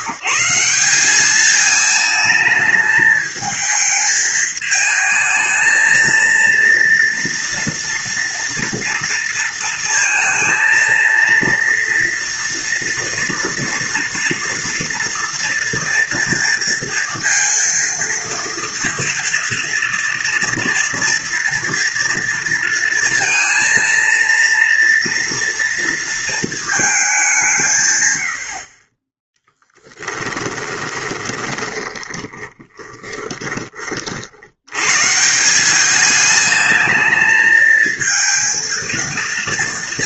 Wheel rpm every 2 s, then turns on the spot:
200, 220, 220, 230, 230, 230, 230, 230, 230, 230, 230, 230, 230, 200, 20, 20, 20, 140, 220, 230.
30-34